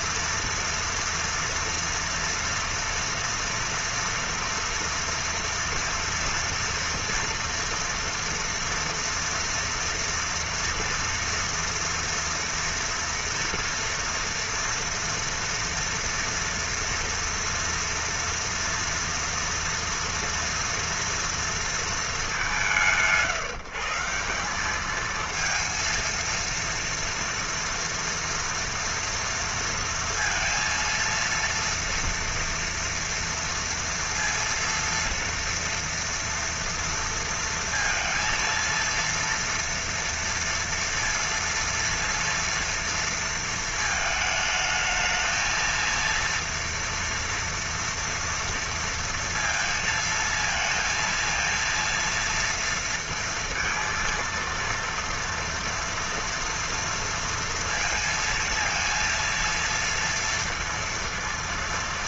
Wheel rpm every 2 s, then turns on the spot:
230, 230, 230, 230, 230, 230, 230, 230, 230, 230, 230, 190, 190, 230, 240, 230, 230, 230, 230, 230, 230, 230, 220, 230, 230, 230, 230, 230, 230, 230, 230.
none